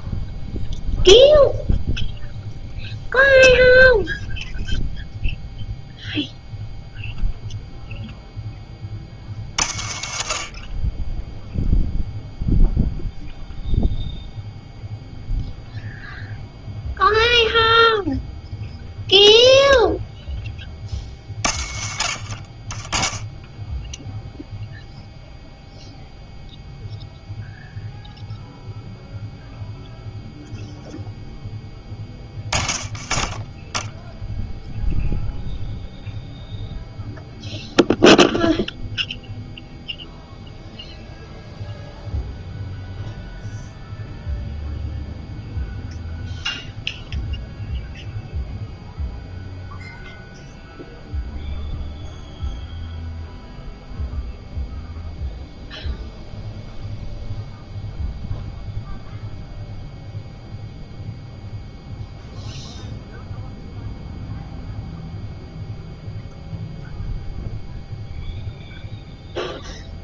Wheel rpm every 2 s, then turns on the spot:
0, 0, 0, 0, 20, 30, 0, 0, 0, 0, 30, 30, 0, 0, 0, 0, 10, 0, 0, 0, 0, 0, 0, 0, 0, 0, 0, 0, 0, 0, 0, 0, 0, 0, 0.
none